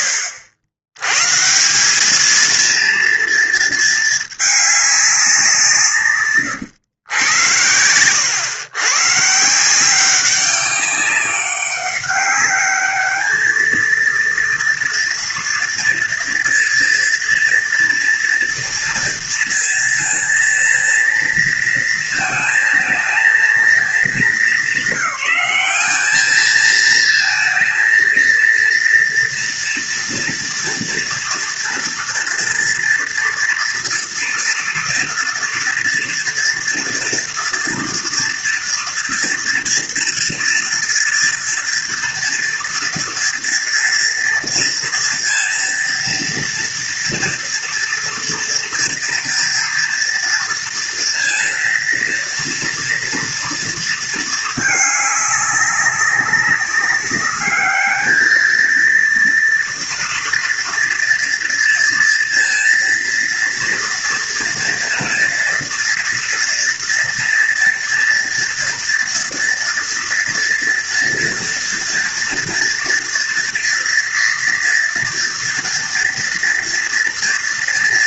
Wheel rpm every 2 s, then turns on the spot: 90, 230, 200, 110, 130, 200, 210, 230, 230, 230, 230, 220, 210, 230, 230, 240, 230, 230, 240, 230, 230, 230, 230, 230, 230, 230, 230, 200, 200, 230, 230, 230, 240, 230, 230, 230, 230, 230, 230.
none